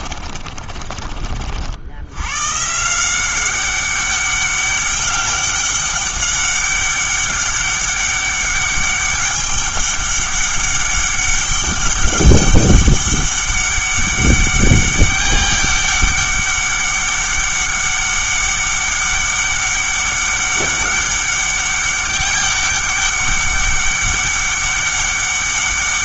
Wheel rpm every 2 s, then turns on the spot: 30, 140, 200, 200, 200, 200, 200, 200, 200, 200, 200, 200, 200.
0-2